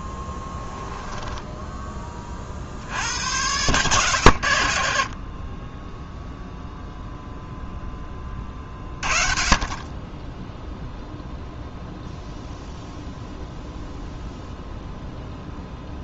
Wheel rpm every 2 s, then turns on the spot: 10, 70, 50, 0, 30, 0, 0, 0.
0-2